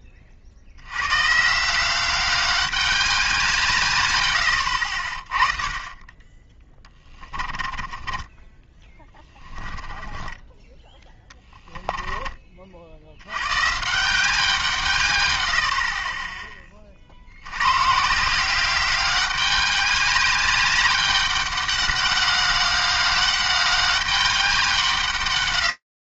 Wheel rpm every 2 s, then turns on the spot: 80, 200, 60, 20, 20, 20, 60, 170, 30, 190, 200, 200, 160.
6-10